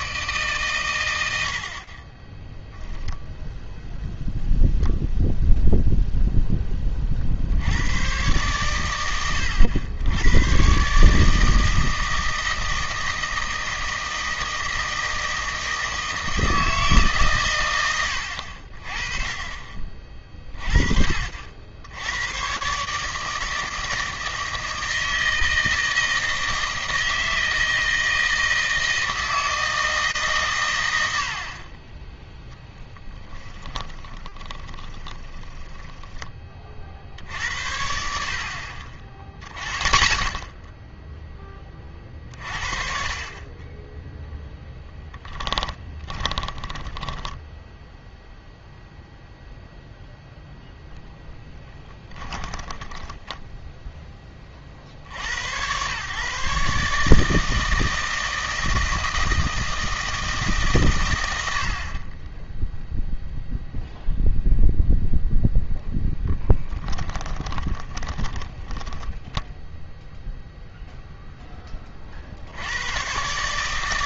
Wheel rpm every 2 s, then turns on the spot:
130, 0, 0, 20, 110, 130, 160, 160, 160, 50, 40, 140, 160, 160, 160, 100, 10, 20, 50, 50, 10, 40, 10, 10, 0, 0, 20, 60, 150, 160, 140, 0, 0, 10, 20, 0, 100.
32-36 52-54 68-70